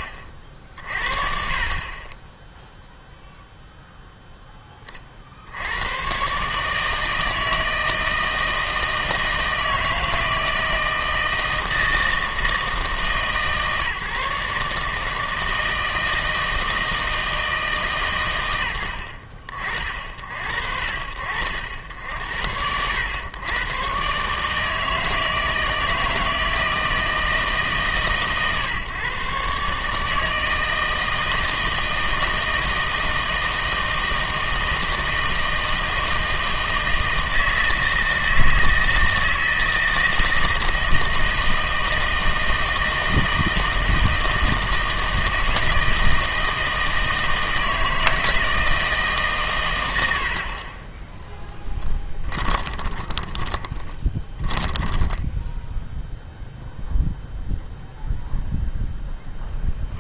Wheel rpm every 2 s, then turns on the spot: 60, 10, 10, 150, 160, 160, 160, 150, 160, 90, 70, 90, 150, 160, 140, 160, 160, 160, 160, 160, 160, 160, 160, 160, 160, 40, 20, 20, 0, 0.
52-56